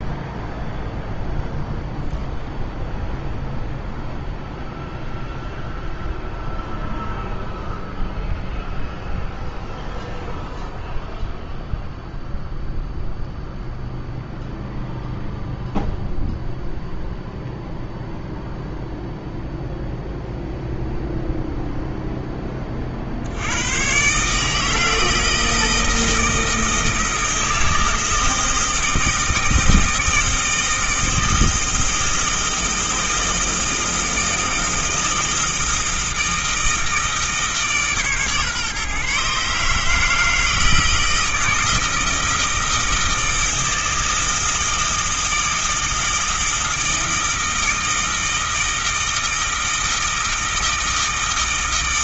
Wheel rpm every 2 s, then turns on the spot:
0, 0, 0, 0, 0, 0, 0, 0, 0, 0, 0, 30, 160, 160, 160, 160, 160, 160, 160, 140, 160, 160, 160, 160, 160, 160.
none